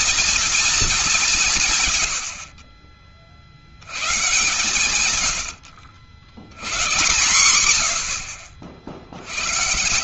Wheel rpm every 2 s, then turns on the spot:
230, 50, 120, 110, 60.
none